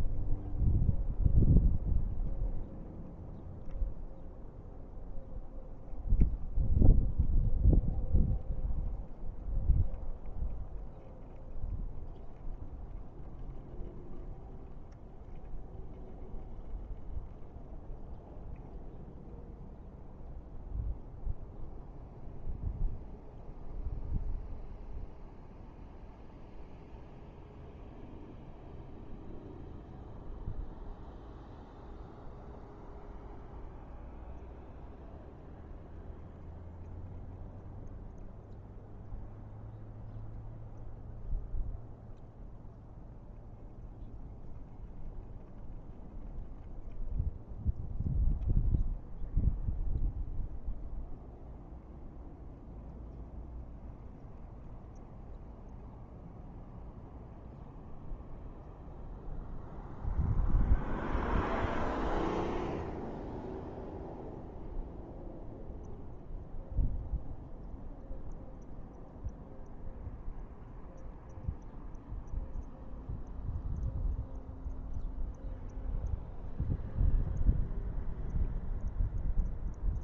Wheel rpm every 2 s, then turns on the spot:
0, 0, 0, 0, 0, 0, 0, 0, 0, 0, 0, 0, 0, 0, 0, 0, 0, 0, 0, 0, 0, 0, 0, 0, 0, 0, 0, 0, 0, 0, 0, 0, 0, 0, 0, 0, 0, 0, 0, 0.
none